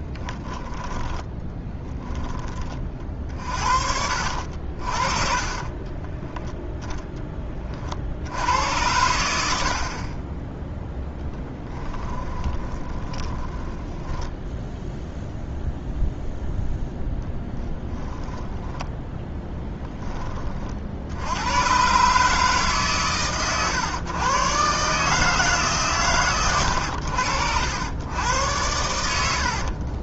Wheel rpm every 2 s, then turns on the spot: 10, 30, 50, 0, 90, 0, 20, 0, 0, 10, 50, 150, 140, 100, 100.
0-4 12-14 18-20